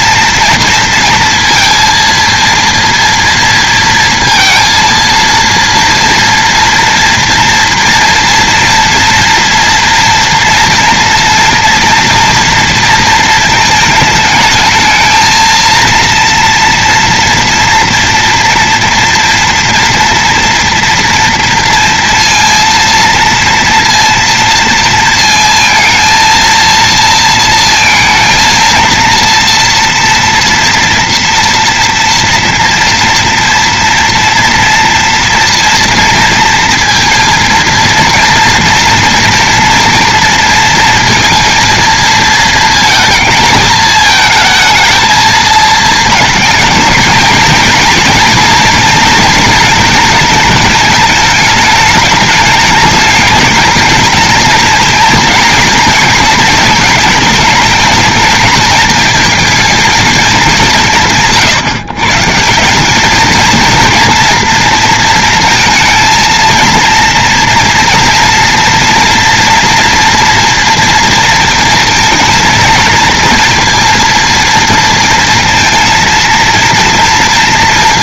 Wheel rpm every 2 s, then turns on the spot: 230, 230, 230, 230, 230, 230, 230, 210, 230, 230, 230, 230, 230, 230, 230, 240, 230, 230, 230, 230, 230, 220, 220, 220, 240, 220, 210, 220, 220, 220, 170, 180, 230, 230, 230, 230, 230, 230, 230.
none